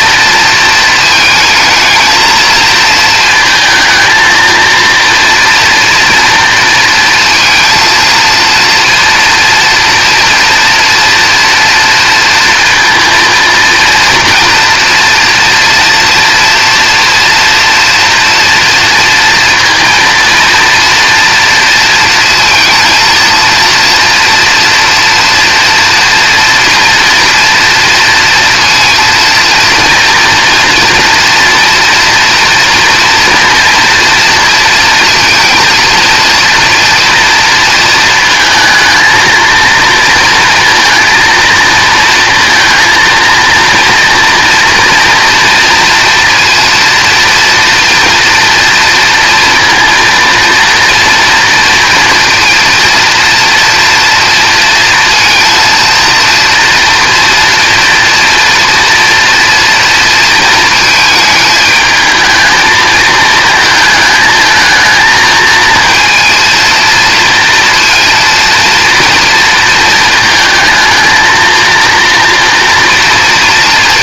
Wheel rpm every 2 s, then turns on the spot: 220, 220, 230, 230, 240, 230, 230, 230, 230, 230, 230, 230, 240, 230, 230, 230, 230, 230, 230, 220, 230, 230, 230, 230, 230, 240, 230, 230, 240, 240, 220, 220, 220, 230, 230, 220, 230.
none